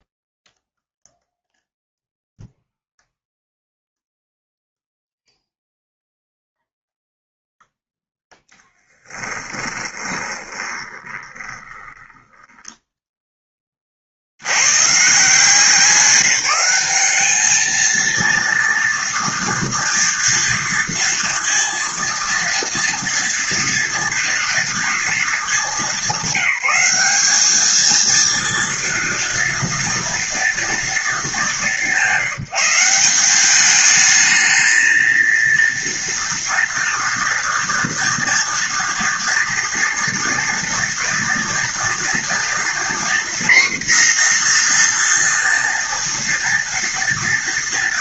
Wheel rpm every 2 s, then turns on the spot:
0, 0, 0, 0, 0, 20, 10, 60, 180, 230, 230, 230, 230, 200, 230, 230, 170, 220, 230, 230, 240, 230, 250, 230.
10-14